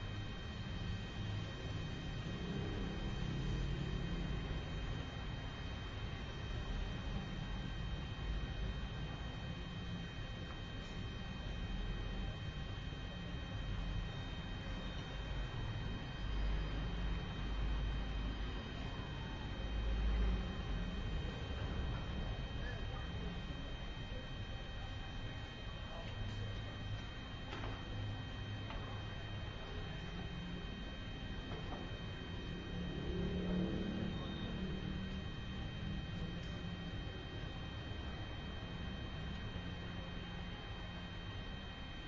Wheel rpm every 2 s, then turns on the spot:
0, 0, 0, 0, 0, 0, 0, 0, 0, 0, 0, 0, 0, 0, 0, 0, 0, 0, 0, 0, 0.
none